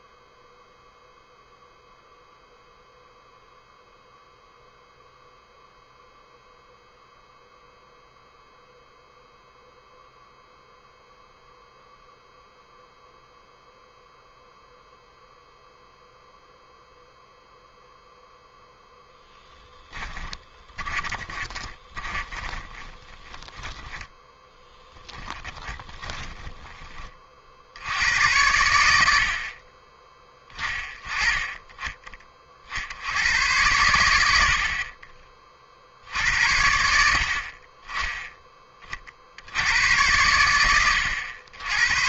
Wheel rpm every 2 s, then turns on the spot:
0, 0, 0, 0, 0, 0, 0, 0, 0, 0, 20, 30, 10, 30, 70, 20, 50, 40, 70, 30, 80.
20-26